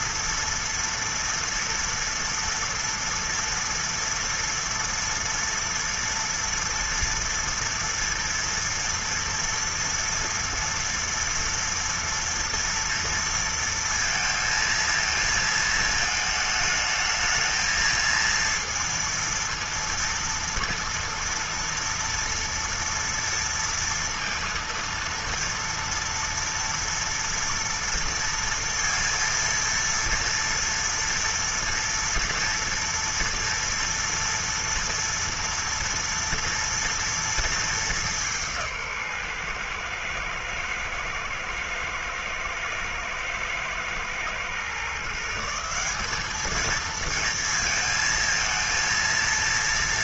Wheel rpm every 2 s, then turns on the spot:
230, 230, 230, 230, 230, 230, 230, 220, 220, 230, 230, 230, 230, 230, 230, 230, 230, 230, 230, 170, 110, 110, 130, 220, 230.
none